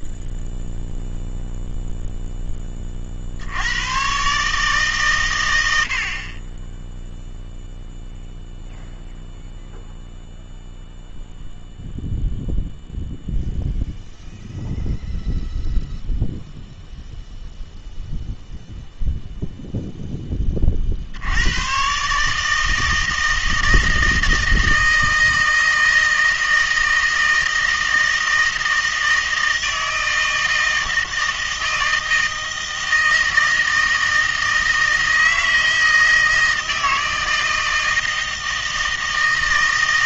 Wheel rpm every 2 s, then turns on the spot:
0, 0, 110, 60, 0, 0, 0, 0, 0, 0, 40, 160, 160, 160, 160, 160, 160, 160, 160, 160.
none